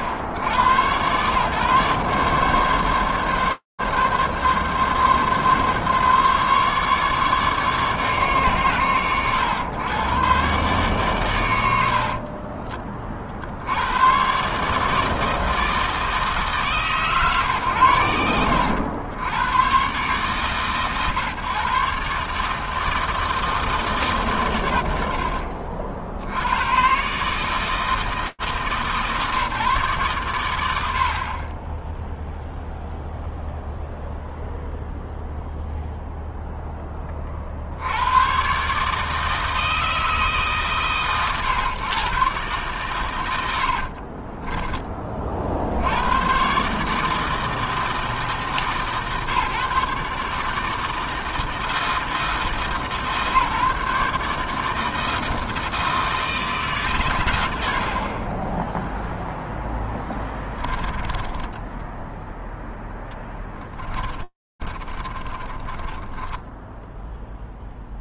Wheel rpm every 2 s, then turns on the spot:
110, 140, 140, 150, 110, 130, 20, 140, 140, 90, 140, 150, 100, 80, 150, 110, 0, 0, 0, 130, 140, 130, 20, 120, 140, 150, 160, 150, 160, 10, 10, 0, 30, 10.
44-46 58-62 64-66